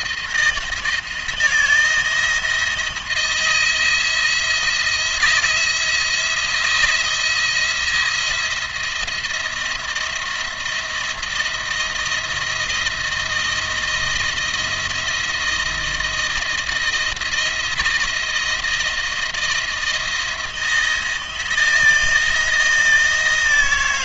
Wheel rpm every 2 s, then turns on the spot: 160, 170, 170, 170, 170, 170, 170, 170, 170, 160, 170, 160.
none